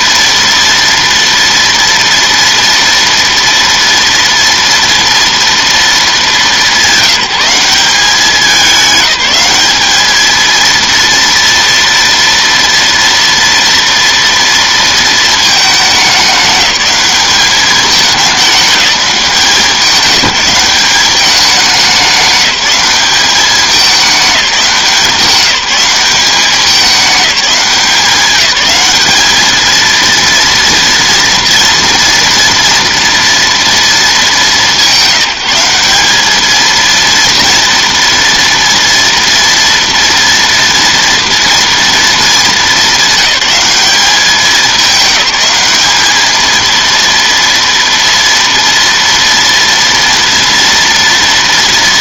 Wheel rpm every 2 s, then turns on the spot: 230, 230, 230, 200, 200, 230, 230, 230, 200, 210, 190, 190, 190, 200, 190, 230, 240, 200, 220, 230, 230, 210, 200, 230, 230, 230.
none